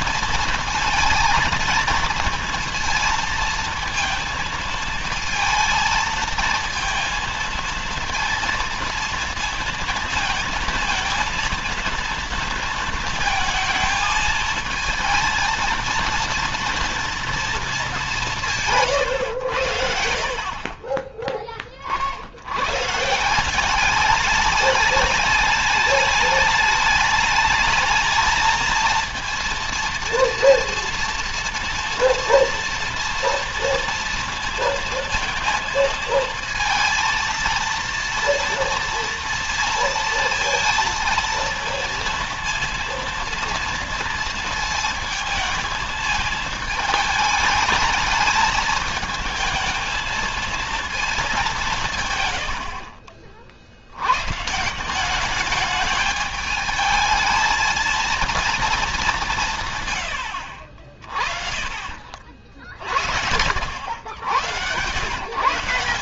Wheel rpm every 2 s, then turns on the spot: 230, 230, 230, 230, 230, 230, 220, 220, 230, 150, 40, 110, 210, 210, 230, 230, 230, 230, 220, 230, 230, 230, 220, 220, 220, 230, 70, 170, 210, 220, 70, 50, 100.
52-54